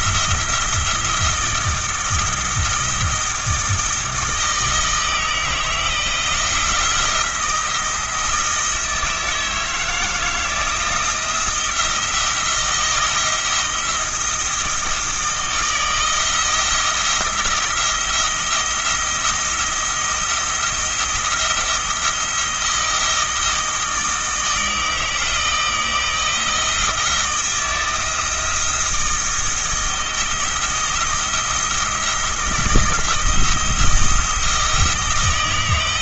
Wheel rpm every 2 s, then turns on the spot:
170, 160, 160, 160, 160, 170, 170, 160, 160, 170, 170, 160, 160, 160, 160, 170, 170, 160.
none